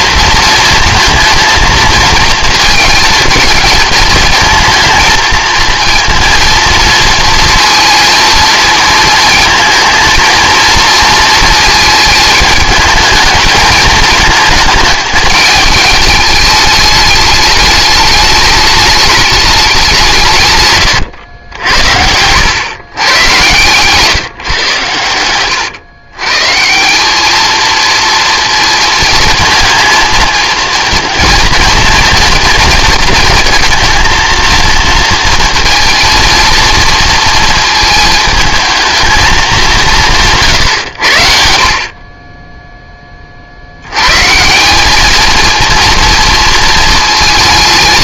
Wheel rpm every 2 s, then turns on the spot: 230, 220, 220, 230, 220, 230, 220, 220, 210, 210, 120, 120, 100, 180, 230, 230, 230, 230, 230, 220, 110, 10, 200, 220.
none